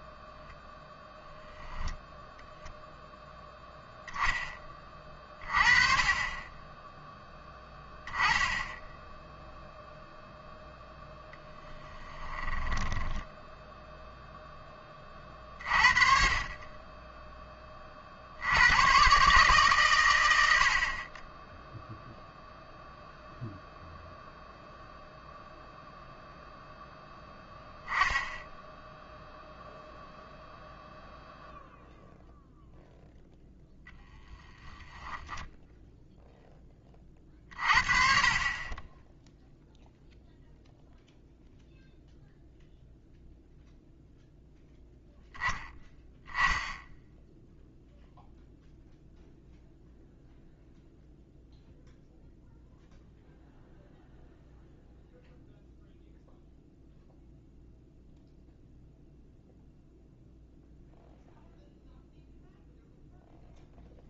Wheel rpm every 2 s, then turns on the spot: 0, 0, 20, 10, 10, 0, 10, 20, 20, 100, 60, 0, 0, 0, 0, 0, 0, 10, 20, 20, 0, 0, 0, 10, 0, 0, 0, 0, 0, 0, 0, 0.
12-14 34-36